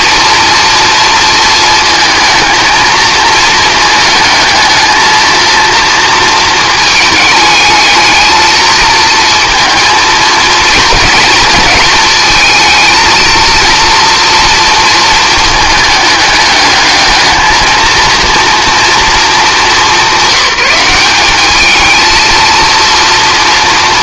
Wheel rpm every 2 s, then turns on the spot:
230, 220, 220, 220, 220, 220, 220, 230, 210, 240, 190, 230.
none